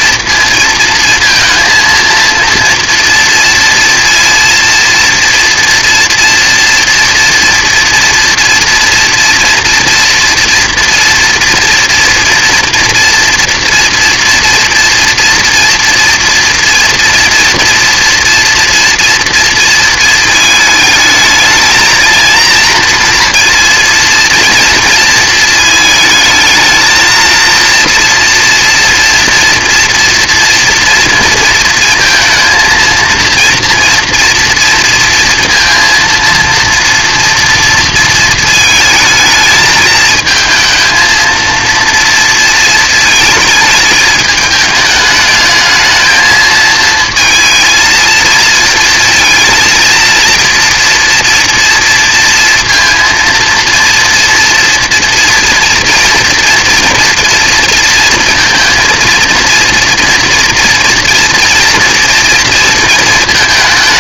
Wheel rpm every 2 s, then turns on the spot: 230, 230, 230, 230, 230, 230, 240, 240, 230, 240, 220, 230, 230, 220, 230, 230, 230, 230, 230, 220, 220, 220, 210, 220, 220, 230, 230, 240, 230, 230, 230, 230.
none